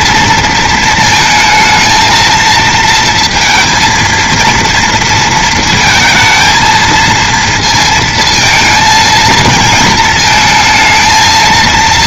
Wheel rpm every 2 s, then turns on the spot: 230, 230, 230, 230, 220, 220.
none